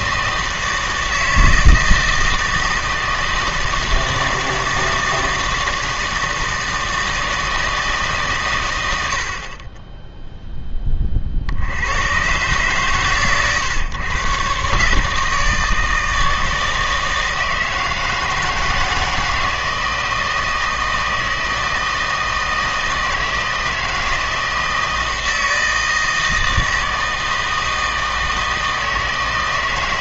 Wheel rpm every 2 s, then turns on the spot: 160, 160, 160, 160, 100, 10, 130, 140, 160, 160, 160, 160, 160, 160, 160.
none